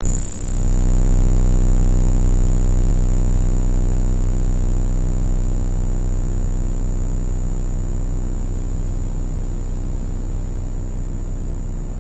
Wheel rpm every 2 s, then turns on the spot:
0, 0, 0, 0, 0, 0.
none